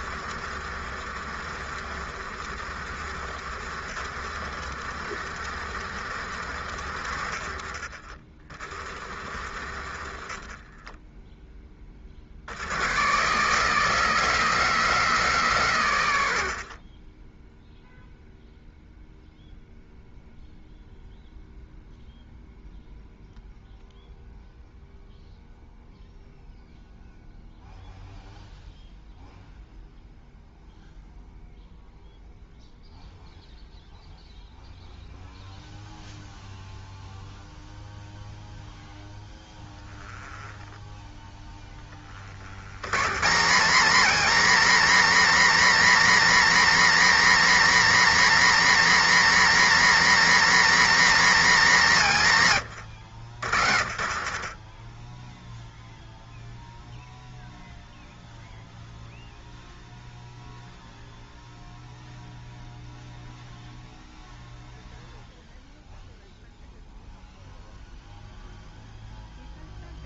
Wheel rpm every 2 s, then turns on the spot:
80, 80, 80, 70, 60, 20, 130, 170, 40, 0, 0, 0, 0, 0, 0, 0, 0, 0, 0, 0, 10, 140, 250, 240, 230, 260, 110, 20, 0, 0, 0, 0, 0, 0, 0.
none